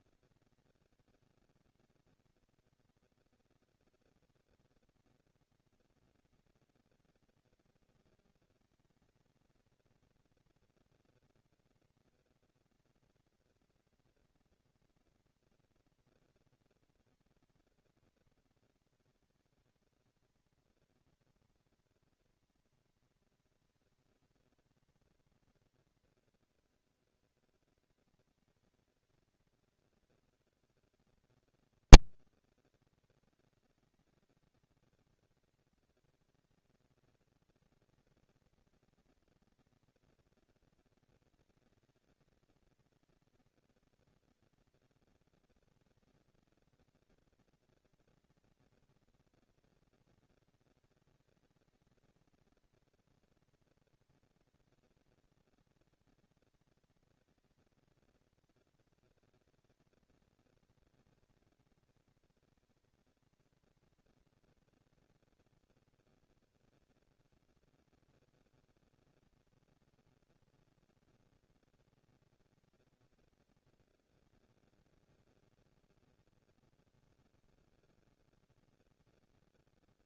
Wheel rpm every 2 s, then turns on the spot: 200, 230, 240, 230, 230, 230, 240, 230, 240, 230, 230, 230, 230, 230, 220, 200, 200, 210, 230, 230, 230, 230, 230, 230, 230, 230, 230, 230, 230, 230, 230, 230, 230, 230, 220, 230, 230, 230, 220, 170.
none